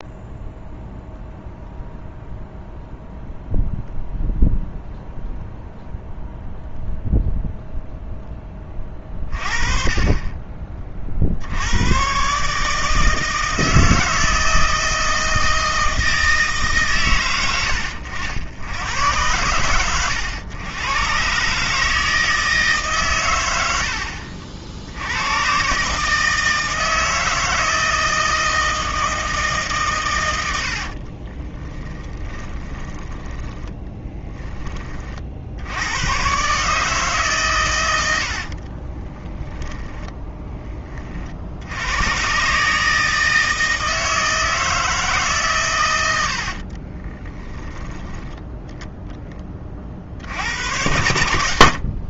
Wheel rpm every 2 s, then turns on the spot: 0, 0, 0, 0, 20, 30, 150, 160, 140, 90, 110, 140, 60, 160, 160, 70, 20, 20, 140, 40, 20, 150, 160, 40, 0, 90.
30-34 38-40 46-48